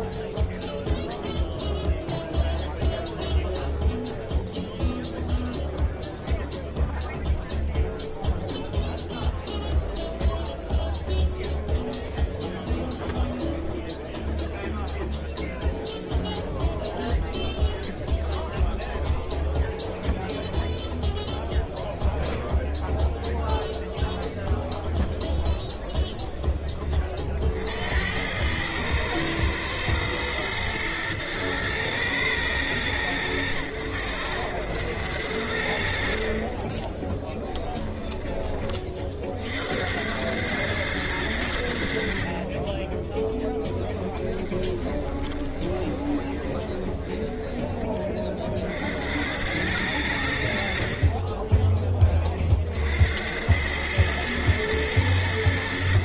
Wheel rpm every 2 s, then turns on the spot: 0, 0, 0, 0, 0, 0, 0, 0, 0, 0, 0, 0, 0, 10, 100, 120, 110, 90, 40, 30, 100, 20, 20, 30, 50, 60, 40, 110.
44-48